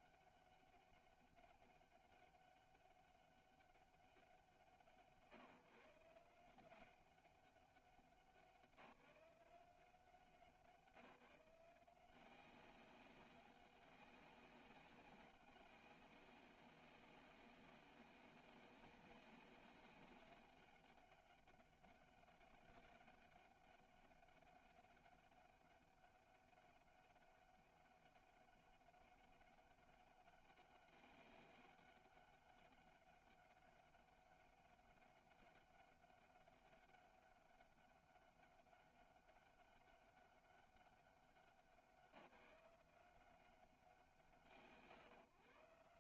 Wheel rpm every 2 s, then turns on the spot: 200, 200, 150, 180, 180, 170, 190, 200, 190, 190, 200, 200, 200, 200, 200, 200, 200, 200, 200, 200, 200, 180, 140.
none